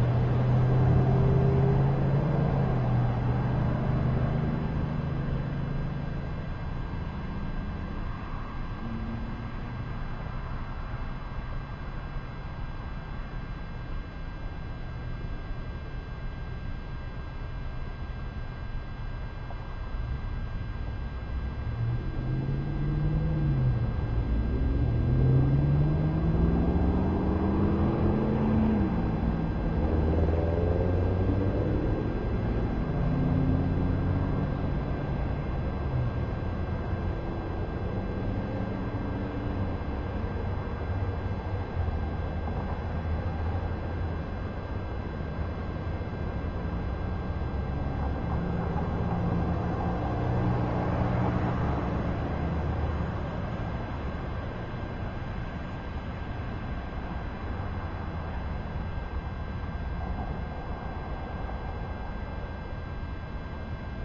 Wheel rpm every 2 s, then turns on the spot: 0, 0, 0, 0, 0, 0, 0, 0, 0, 0, 0, 0, 0, 0, 0, 0, 0, 0, 0, 0, 0, 0, 0, 0, 0, 0, 0, 0, 0, 0, 0, 0.
none